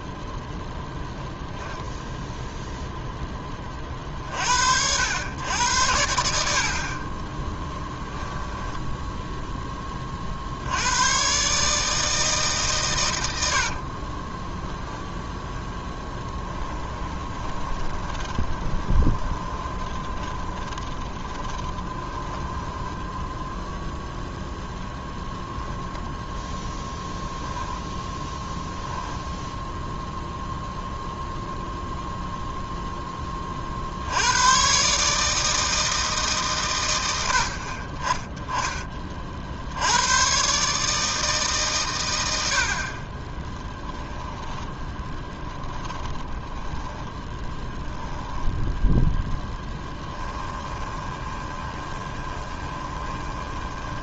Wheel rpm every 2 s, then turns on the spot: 0, 0, 110, 20, 10, 90, 140, 10, 20, 20, 20, 10, 0, 0, 10, 0, 0, 120, 110, 20, 140, 50, 10, 10, 10, 20, 20.
6-10 16-24 28-30 44-48 50-54